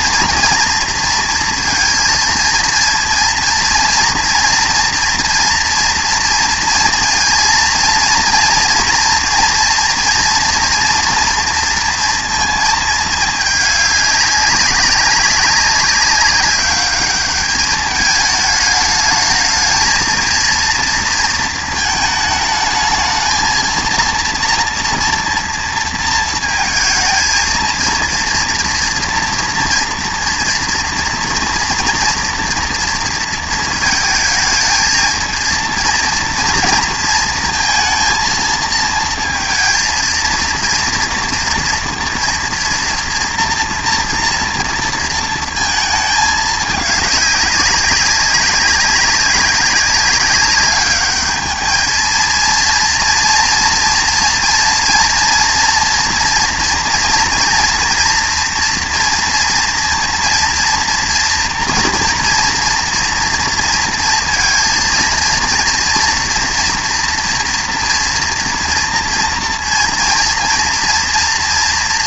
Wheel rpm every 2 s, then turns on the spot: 230, 230, 230, 230, 230, 240, 220, 200, 200, 210, 230, 220, 230, 230, 230, 230, 230, 220, 230, 230, 230, 230, 230, 210, 190, 200, 230, 230, 230, 230, 230, 230, 230, 230, 230, 230.
none